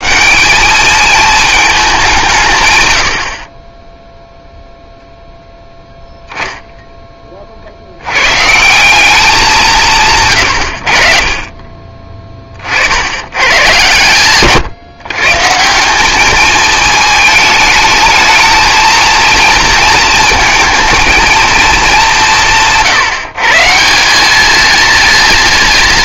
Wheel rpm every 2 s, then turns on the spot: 210, 110, 0, 10, 170, 90, 40, 130, 220, 230, 230, 160, 220.
none